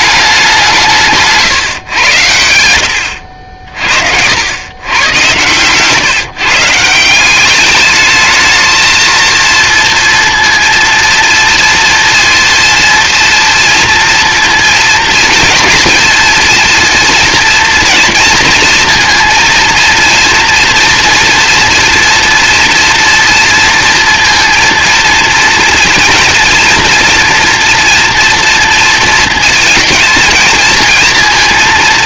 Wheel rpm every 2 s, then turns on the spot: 170, 80, 100, 150, 220, 230, 240, 230, 230, 230, 230, 230, 230, 230, 230, 230.
none